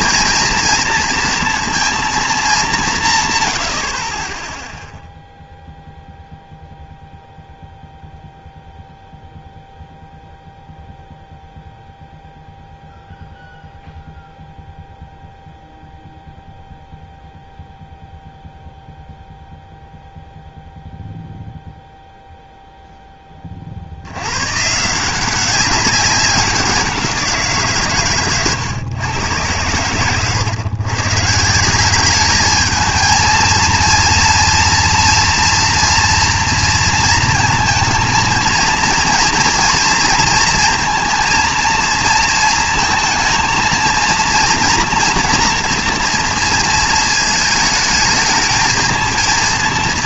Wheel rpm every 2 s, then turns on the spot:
230, 200, 10, 0, 0, 0, 0, 0, 0, 0, 0, 0, 140, 190, 130, 130, 210, 230, 230, 220, 230, 230, 230, 230, 220.
none